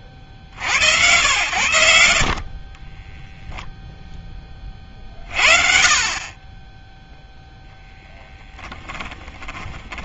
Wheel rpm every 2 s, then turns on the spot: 60, 20, 20, 20, 10.
8-10